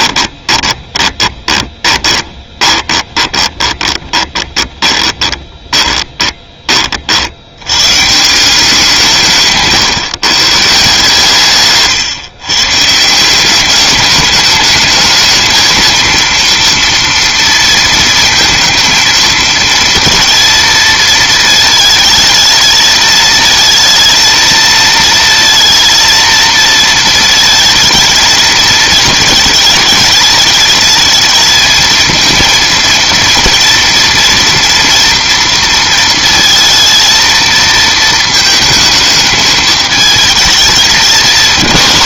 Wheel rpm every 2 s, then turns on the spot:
20, 20, 20, 30, 170, 140, 140, 210, 230, 230, 230, 220, 230, 230, 220, 220, 230, 230, 230, 220, 210.
0-6